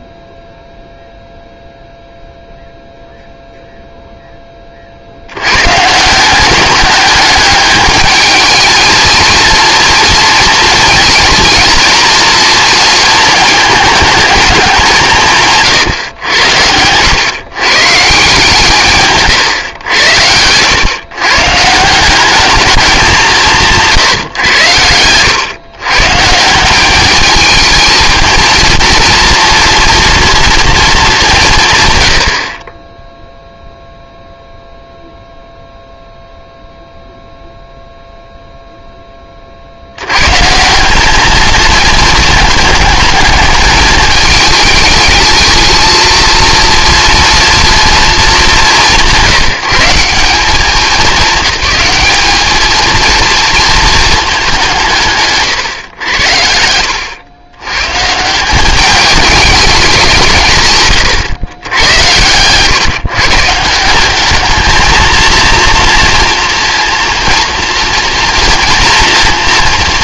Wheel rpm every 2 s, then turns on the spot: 0, 0, 40, 200, 220, 230, 230, 180, 90, 150, 110, 210, 90, 190, 230, 220, 20, 0, 0, 0, 180, 210, 220, 230, 190, 200, 220, 180, 90, 200, 120, 140, 220, 230, 230.
60-62